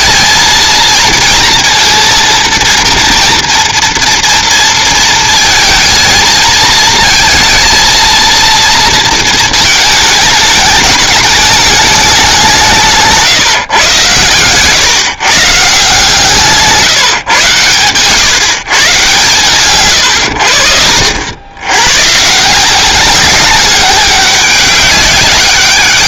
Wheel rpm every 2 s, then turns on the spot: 230, 230, 230, 220, 230, 210, 170, 130, 140, 140, 70, 180, 200.
none